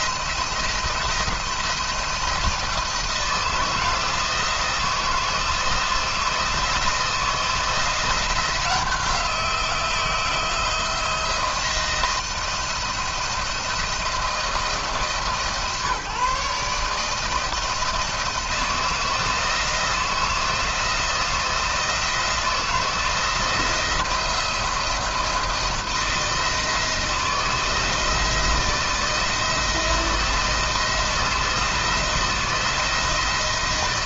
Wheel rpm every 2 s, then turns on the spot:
170, 170, 160, 170, 170, 170, 170, 140, 160, 160, 160, 170, 170, 160, 170, 170, 160.
none